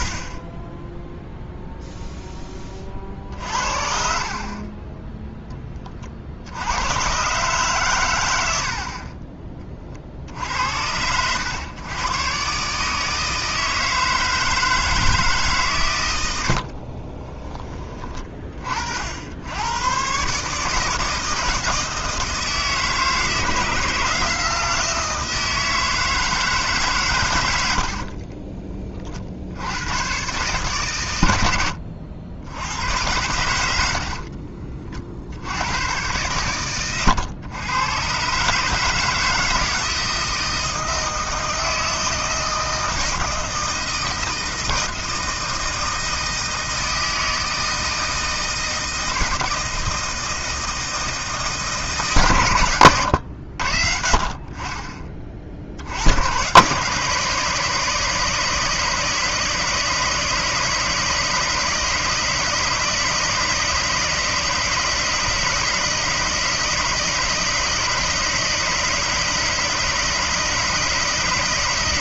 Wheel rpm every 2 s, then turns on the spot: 10, 30, 30, 80, 60, 80, 140, 160, 40, 50, 150, 160, 160, 140, 30, 140, 90, 40, 110, 150, 160, 160, 160, 160, 160, 160, 110, 20, 130, 160, 160, 160, 160, 160, 160, 160.
4-6 16-18 36-38